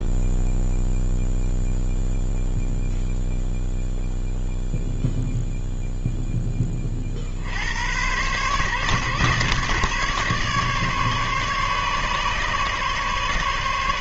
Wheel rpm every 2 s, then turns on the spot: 0, 0, 0, 20, 140, 140, 140.
none